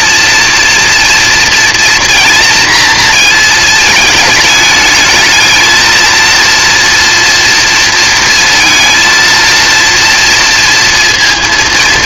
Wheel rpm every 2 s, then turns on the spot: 230, 230, 220, 230, 230, 230.
none